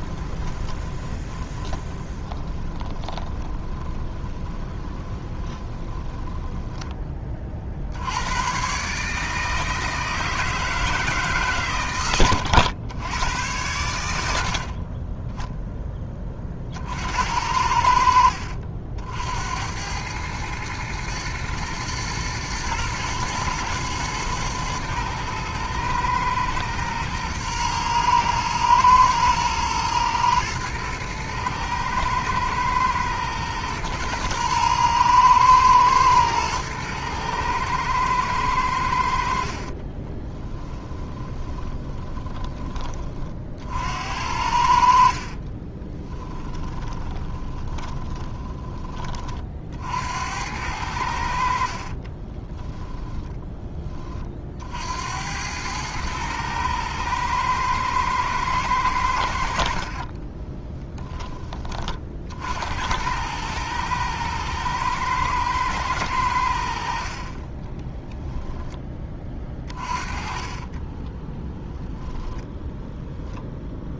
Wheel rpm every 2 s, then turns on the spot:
20, 30, 20, 20, 140, 160, 100, 30, 60, 60, 110, 110, 110, 110, 120, 110, 120, 110, 110, 80, 10, 30, 50, 20, 20, 80, 10, 70, 110, 100, 10, 90, 110, 50, 10, 20, 0.
0-6 14-16 40-42 44-48 52-54 70-72